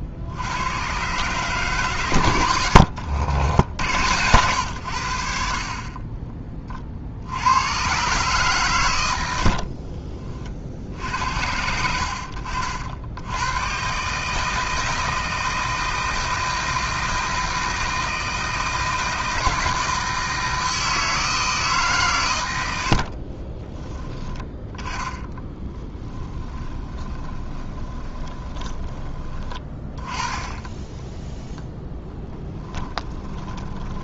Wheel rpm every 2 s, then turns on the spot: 100, 90, 100, 30, 120, 60, 60, 160, 160, 160, 160, 90, 10, 20, 20, 10, 10.
2-4 22-24 26-30 32-34